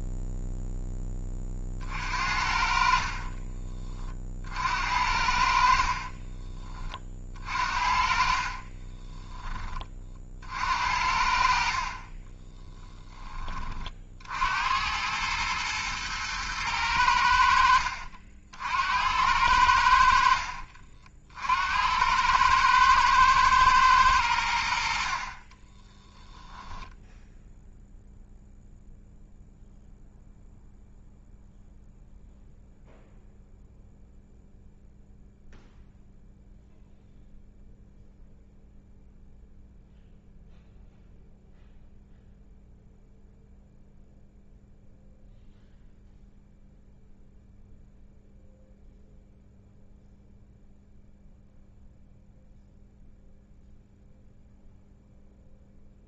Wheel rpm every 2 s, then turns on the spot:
10, 50, 60, 30, 20, 70, 10, 80, 100, 70, 60, 110, 70, 10, 0, 0, 0, 0, 0, 0, 0, 0, 0, 0, 0, 0, 0, 0.
8-10 20-22